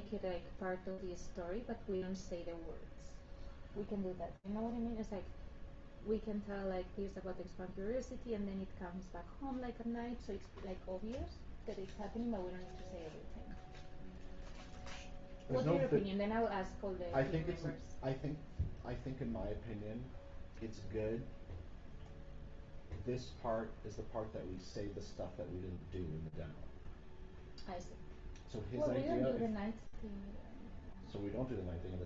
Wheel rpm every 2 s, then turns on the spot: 0, 0, 0, 0, 0, 0, 0, 0, 0, 0, 0, 0, 0, 0, 0, 0.
none